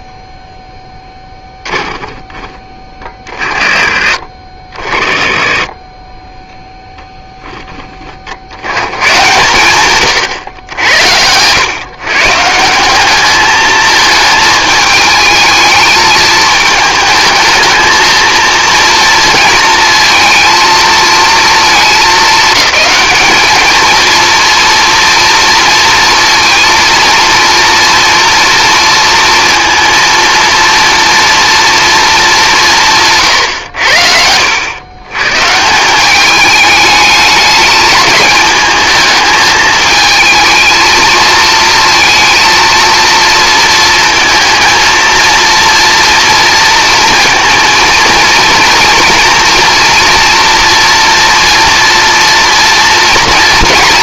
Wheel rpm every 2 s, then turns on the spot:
0, 20, 40, 10, 100, 90, 170, 220, 220, 230, 230, 210, 230, 230, 230, 230, 170, 100, 210, 220, 220, 230, 230, 230, 230, 230, 230.
10-12